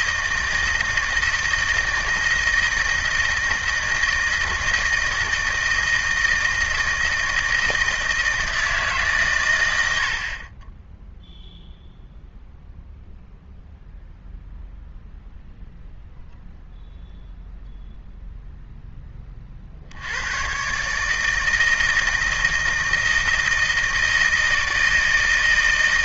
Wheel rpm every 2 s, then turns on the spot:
160, 160, 160, 160, 160, 20, 0, 0, 0, 0, 130, 160, 160.
none